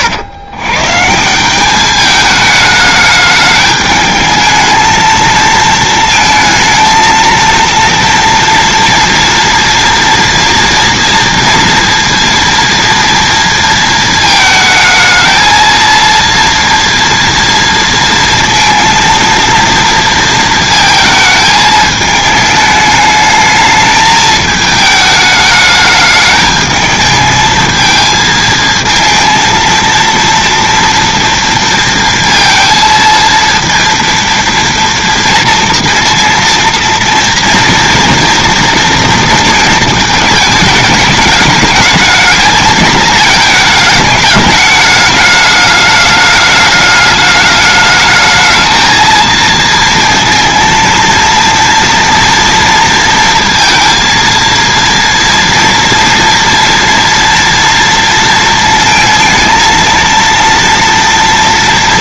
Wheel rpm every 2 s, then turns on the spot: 120, 210, 220, 220, 230, 230, 230, 220, 230, 230, 230, 210, 210, 220, 230, 230, 230, 230, 230, 230, 210, 220, 210, 210, 220, 230, 230, 230, 230, 230, 230.
none